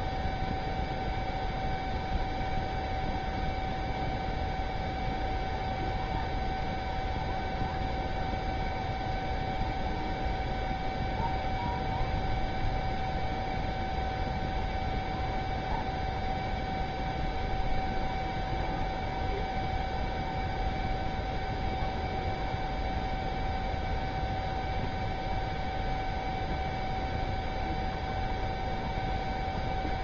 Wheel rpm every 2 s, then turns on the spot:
0, 0, 0, 0, 0, 0, 0, 0, 0, 0, 0, 0, 0, 0, 0.
none